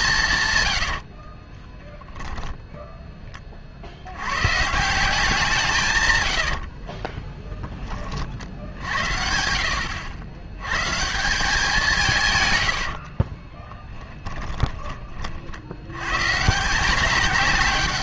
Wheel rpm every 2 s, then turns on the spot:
140, 10, 160, 60, 60, 140, 80, 20, 170.
6-10 12-14